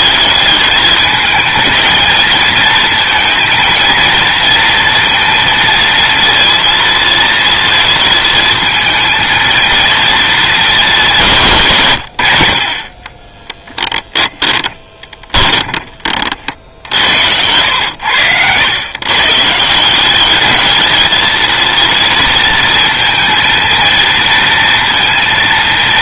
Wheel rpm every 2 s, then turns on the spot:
210, 230, 230, 230, 220, 210, 60, 20, 70, 120, 220, 220, 230.
14-18